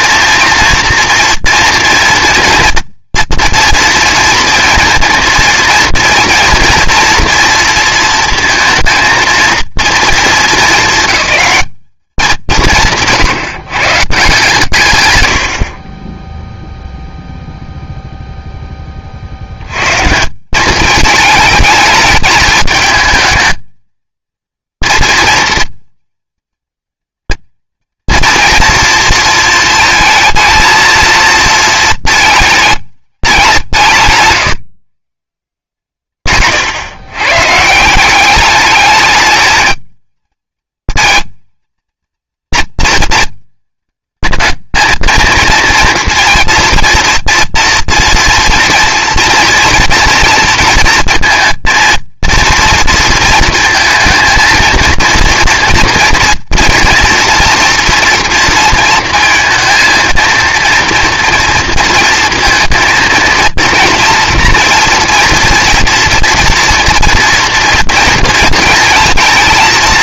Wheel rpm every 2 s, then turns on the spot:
240, 230, 230, 230, 230, 220, 160, 140, 0, 20, 200, 220, 230, 230, 240, 230, 220, 150, 120, 210, 230, 230, 220, 230, 240, 230, 230, 230, 230, 230, 230, 230, 230, 240, 230.
none